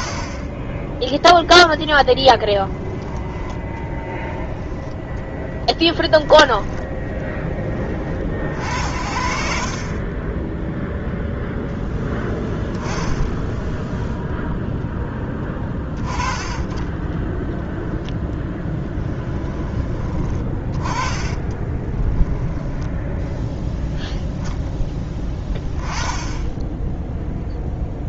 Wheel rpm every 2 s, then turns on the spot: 20, 10, 10, 10, 70, 0, 10, 0, 20, 10, 20, 10, 10, 10.
0-2 16-24